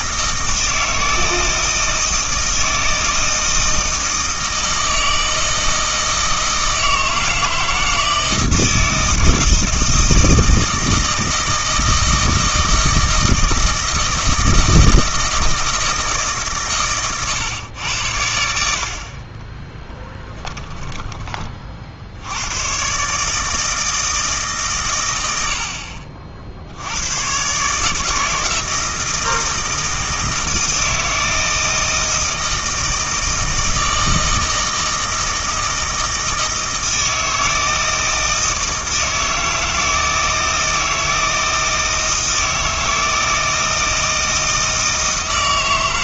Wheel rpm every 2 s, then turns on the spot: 160, 160, 160, 160, 160, 160, 160, 160, 130, 70, 30, 120, 130, 80, 160, 170, 160, 160, 160, 160, 160, 160, 160.
20-22